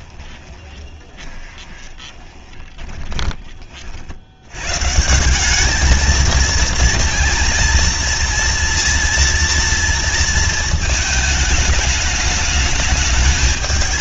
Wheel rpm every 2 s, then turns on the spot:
20, 10, 170, 230, 240, 220, 220.
0-2